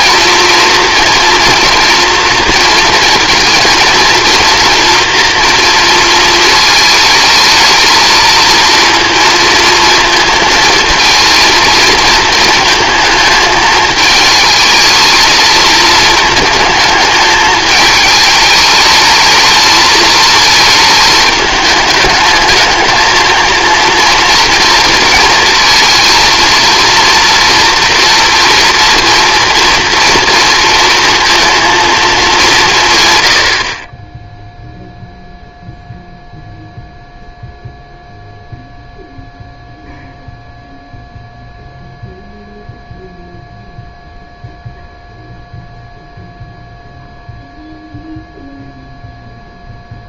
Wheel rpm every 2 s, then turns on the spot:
240, 230, 230, 220, 230, 230, 220, 220, 210, 210, 220, 210, 230, 230, 240, 230, 160, 0, 0, 0, 0, 0, 0, 0, 0.
none